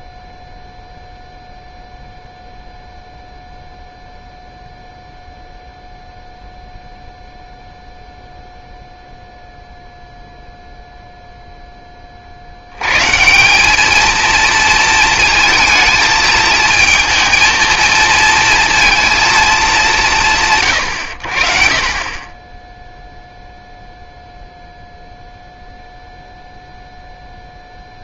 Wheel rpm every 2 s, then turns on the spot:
0, 0, 0, 0, 0, 0, 110, 230, 220, 230, 90, 0, 0, 0.
none